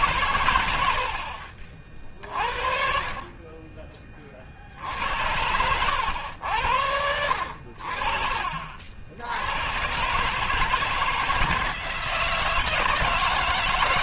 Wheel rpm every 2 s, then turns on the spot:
90, 50, 60, 80, 60, 160, 160.
none